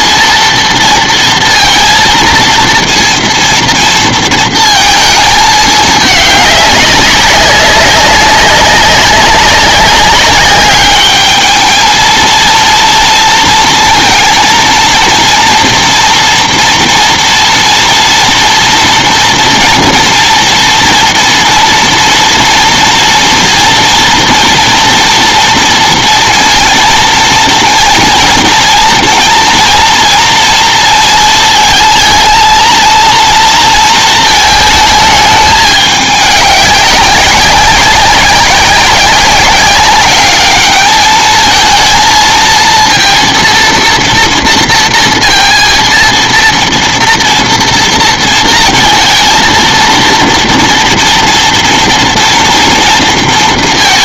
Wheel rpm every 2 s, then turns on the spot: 230, 230, 230, 200, 200, 200, 230, 230, 230, 230, 230, 230, 230, 230, 230, 230, 220, 220, 200, 190, 210, 230, 230, 230, 230, 230, 230.
none